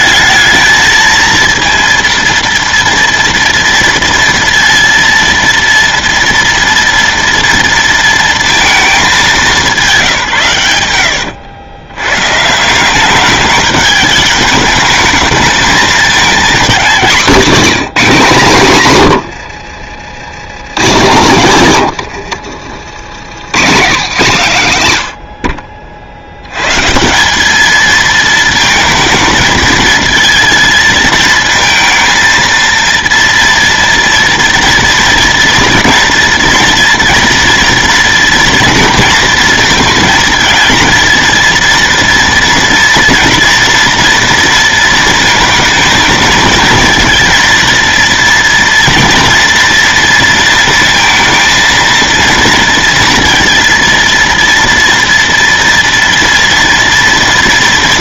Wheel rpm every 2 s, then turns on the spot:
220, 230, 230, 230, 220, 110, 180, 210, 220, 180, 130, 90, 140, 130, 220, 220, 230, 230, 230, 230, 230, 230, 230, 230, 230, 230, 230, 230, 230.
none